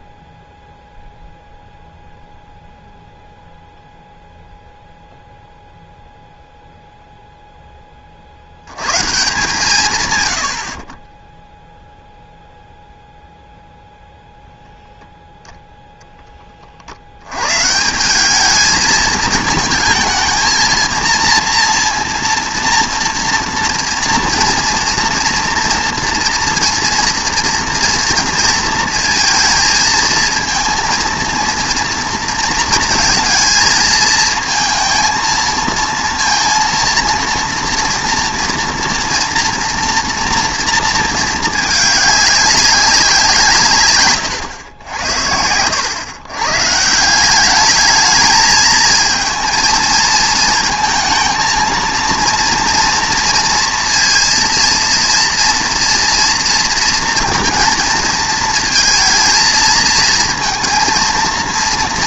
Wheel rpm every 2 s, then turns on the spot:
0, 0, 0, 0, 110, 60, 0, 0, 50, 220, 230, 230, 230, 230, 230, 230, 230, 230, 230, 230, 230, 190, 90, 150, 220, 220, 230, 230, 230, 220, 230.
none